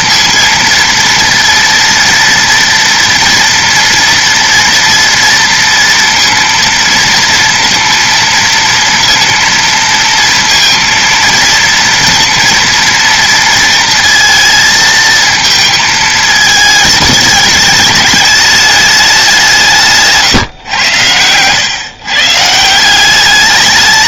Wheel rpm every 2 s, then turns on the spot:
230, 230, 230, 230, 230, 230, 230, 230, 220, 210, 120, 160.
none